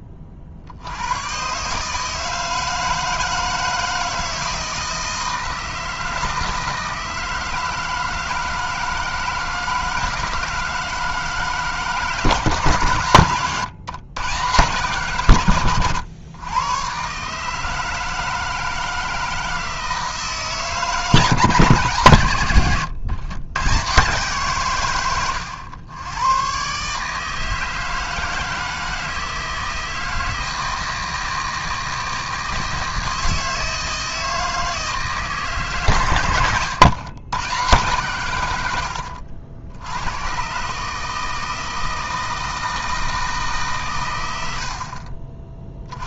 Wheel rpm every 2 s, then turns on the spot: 80, 160, 160, 160, 160, 160, 140, 150, 120, 160, 160, 120, 130, 130, 160, 160, 160, 160, 110, 80, 150, 160, 60.
none